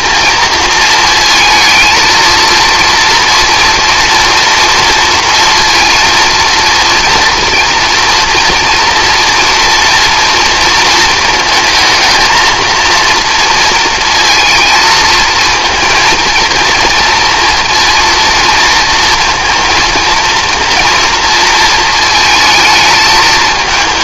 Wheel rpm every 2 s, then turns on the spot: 230, 230, 230, 230, 240, 230, 220, 220, 230, 230, 230, 220.
none